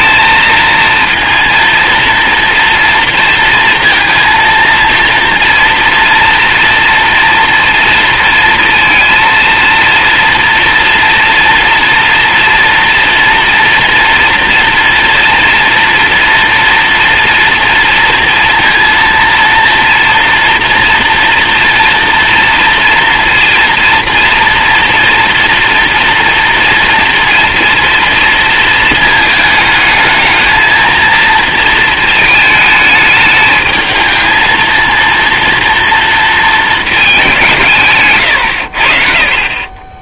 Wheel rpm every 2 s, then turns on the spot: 230, 230, 230, 240, 230, 230, 230, 230, 230, 230, 230, 240, 230, 230, 230, 230, 220, 230, 220, 60.
none